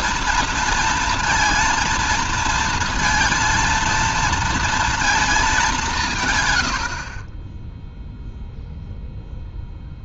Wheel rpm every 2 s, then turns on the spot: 230, 230, 230, 130, 0.
none